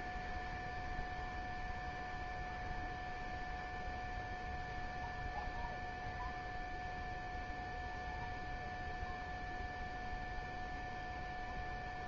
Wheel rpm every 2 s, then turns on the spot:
0, 0, 0, 0, 0, 0.
none